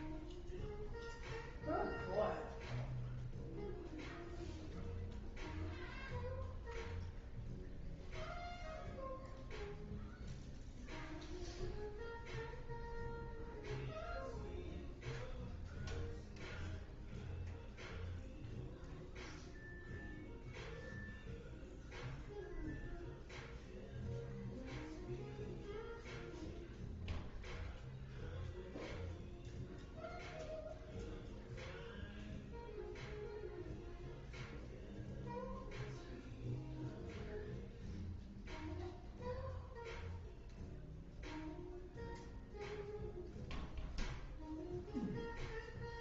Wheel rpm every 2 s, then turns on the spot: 0, 0, 0, 0, 0, 0, 0, 0, 0, 0, 0, 0, 0, 0, 0, 0, 0, 0, 0, 0, 0, 0, 0.
none